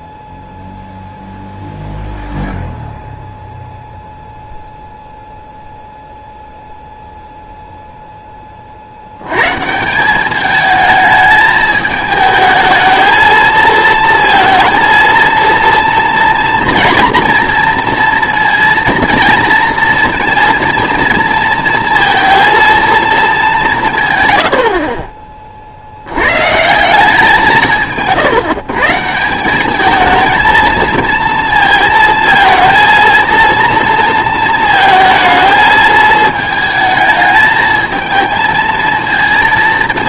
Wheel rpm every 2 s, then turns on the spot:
0, 0, 0, 0, 60, 210, 220, 230, 230, 230, 230, 230, 50, 170, 150, 230, 230, 220, 220, 230.
none